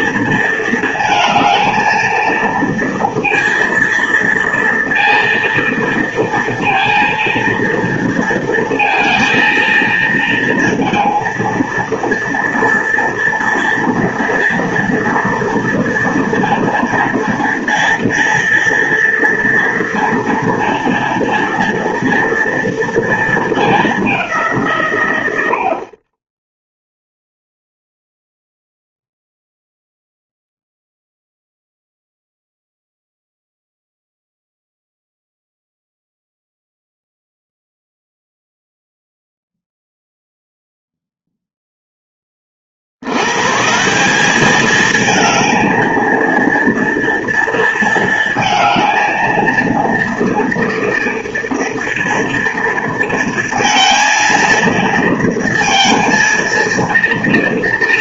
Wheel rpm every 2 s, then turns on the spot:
230, 230, 230, 230, 230, 230, 230, 230, 230, 230, 230, 230, 160, 0, 0, 0, 0, 0, 0, 0, 0, 40, 210, 230, 230, 230, 230, 230, 230.
none